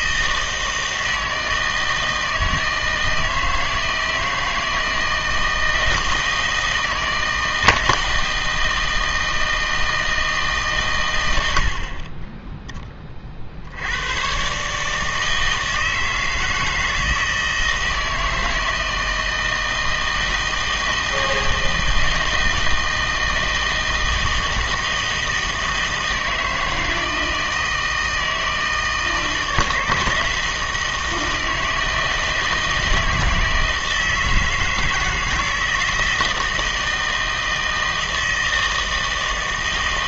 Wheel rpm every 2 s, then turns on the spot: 160, 160, 160, 160, 160, 150, 10, 130, 160, 160, 160, 160, 160, 160, 160, 160, 160, 160, 160, 160.
none